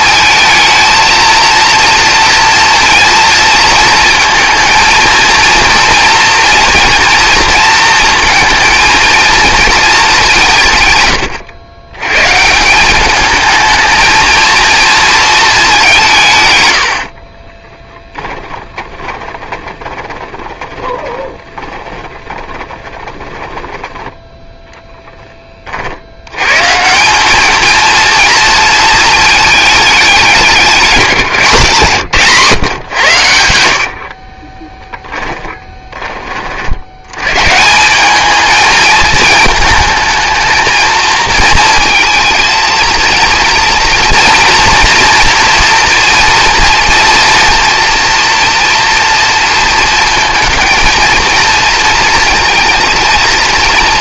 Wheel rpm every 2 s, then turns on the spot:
230, 230, 220, 230, 220, 130, 190, 230, 100, 20, 20, 20, 0, 160, 220, 190, 120, 10, 70, 220, 220, 230, 240, 230, 230, 230, 230.
16-24 34-36